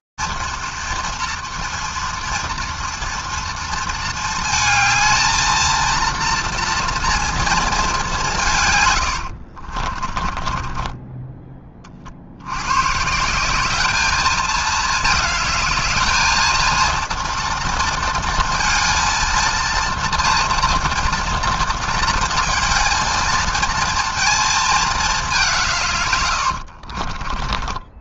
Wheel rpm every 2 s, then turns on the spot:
230, 230, 220, 230, 150, 30, 70, 220, 220, 230, 240, 230, 230, 90.
10-12 26-28